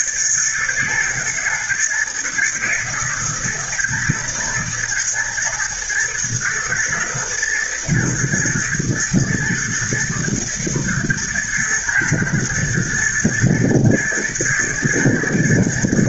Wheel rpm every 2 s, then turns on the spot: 110, 120, 110, 120, 110, 120, 120, 120.
none